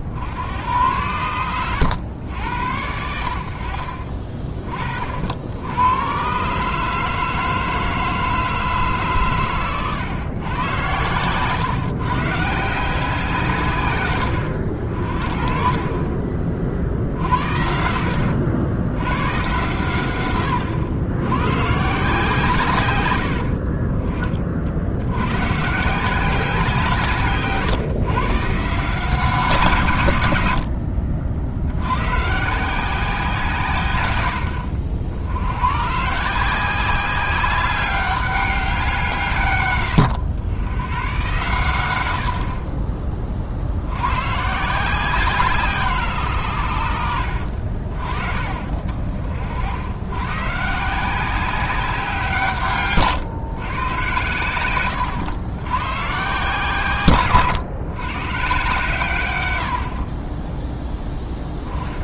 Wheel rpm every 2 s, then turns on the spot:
100, 70, 40, 150, 150, 120, 170, 60, 50, 100, 90, 130, 80, 160, 160, 60, 170, 70, 190, 180, 100, 20, 160, 90, 40, 150, 150, 110, 130, 130, 10.
none